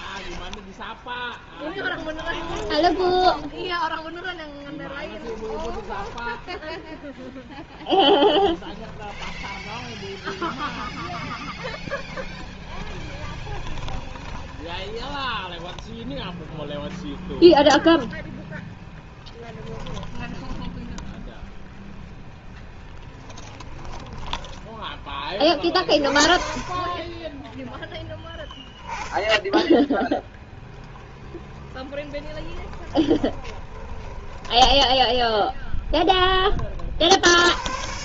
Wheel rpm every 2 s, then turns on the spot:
0, 10, 10, 0, 10, 0, 20, 20, 0, 10, 0, 10, 10, 20, 0, 10, 10, 0, 40.
2-6 8-10 12-16 22-24 32-34